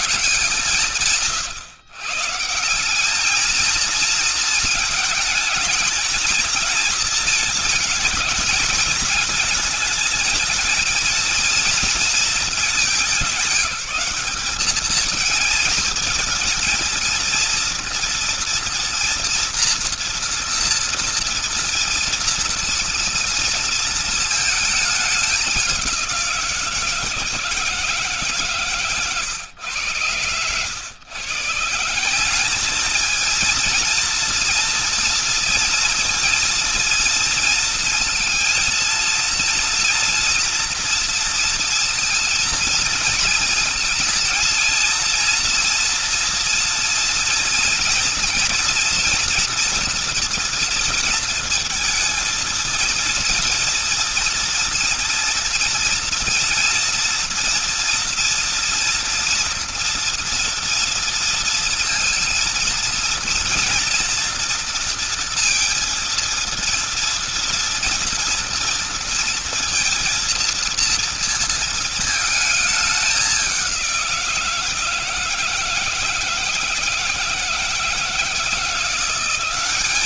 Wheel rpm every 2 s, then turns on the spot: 160, 140, 230, 220, 220, 220, 220, 200, 230, 230, 240, 230, 220, 180, 150, 100, 180, 230, 230, 230, 230, 230, 230, 230, 230, 230, 230, 230, 230, 230, 230, 230, 230, 230, 230, 230, 220, 180, 160, 160.
none